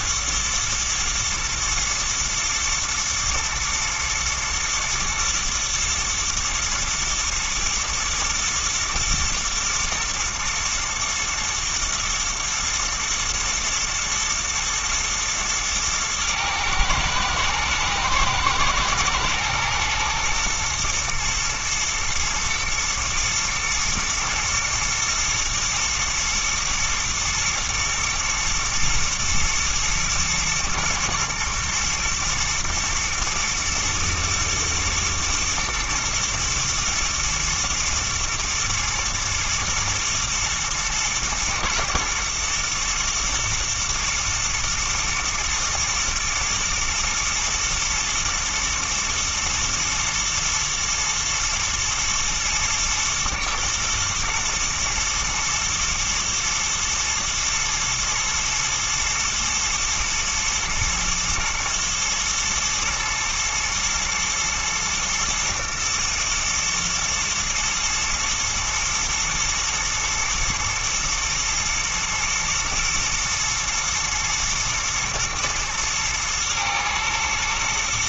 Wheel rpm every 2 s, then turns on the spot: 120, 110, 110, 120, 120, 120, 120, 110, 110, 110, 120, 110, 120, 120, 110, 110, 110, 120, 120, 120, 110, 120, 120, 110, 120, 120, 110, 120, 110, 110, 120, 110, 110, 110, 120, 120, 120, 120, 110.
none